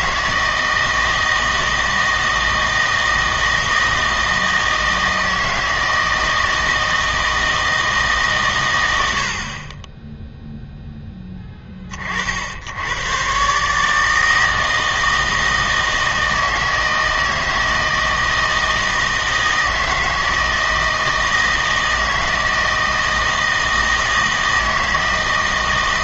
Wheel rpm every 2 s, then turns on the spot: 160, 160, 160, 160, 120, 0, 70, 160, 160, 160, 160, 160, 160.
none